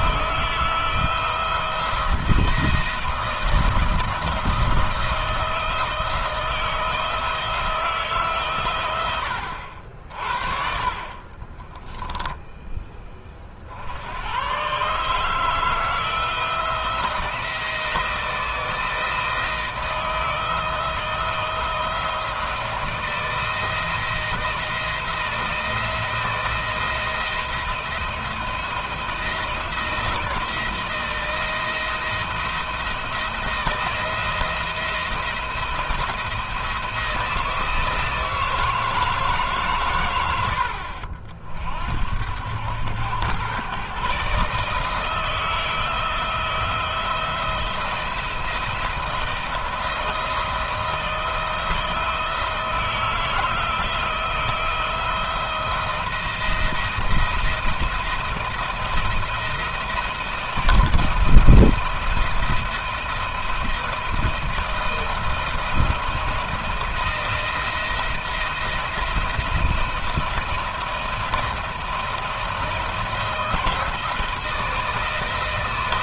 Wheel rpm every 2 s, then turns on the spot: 160, 170, 170, 160, 120, 50, 10, 110, 160, 160, 160, 170, 170, 170, 170, 160, 170, 170, 170, 160, 90, 90, 150, 160, 170, 160, 160, 160, 170, 170, 170, 170, 160, 170, 170, 170, 170, 160.
none